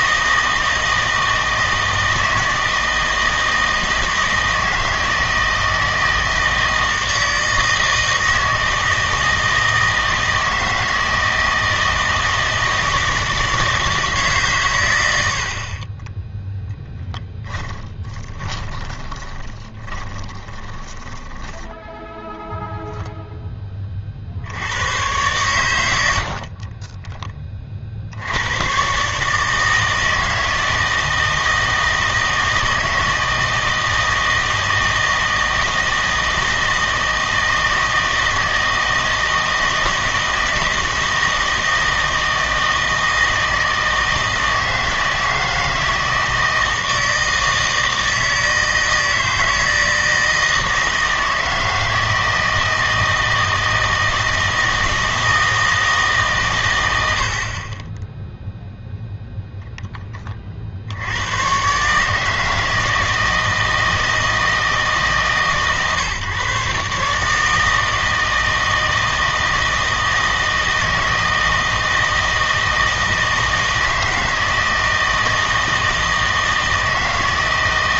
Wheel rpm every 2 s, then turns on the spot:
160, 160, 160, 160, 160, 160, 160, 120, 0, 20, 20, 0, 90, 30, 110, 160, 160, 160, 160, 160, 160, 160, 160, 160, 160, 160, 160, 160, 110, 0, 60, 160, 160, 140, 160, 160, 160, 160, 160.
18-22